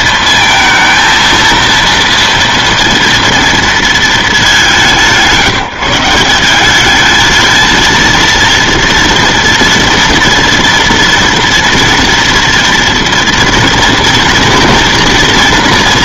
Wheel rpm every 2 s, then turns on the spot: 230, 240, 170, 190, 230, 240, 230, 230.
none